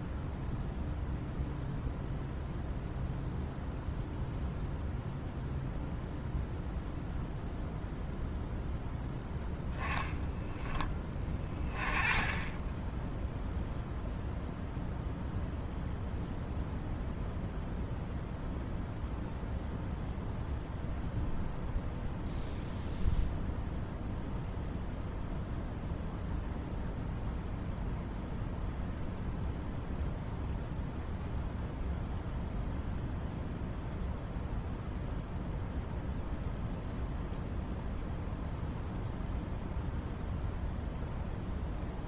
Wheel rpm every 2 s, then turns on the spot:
0, 0, 0, 0, 0, 20, 10, 0, 0, 0, 0, 0, 0, 0, 0, 0, 0, 0, 0, 0, 0.
none